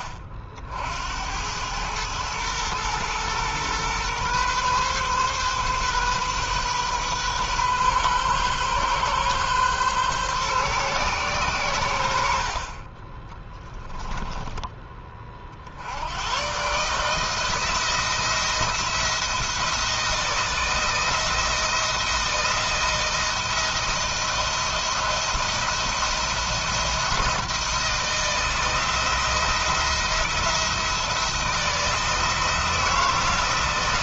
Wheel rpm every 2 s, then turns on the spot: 70, 120, 130, 130, 130, 120, 30, 30, 150, 170, 170, 170, 170, 170, 160, 170, 170.
none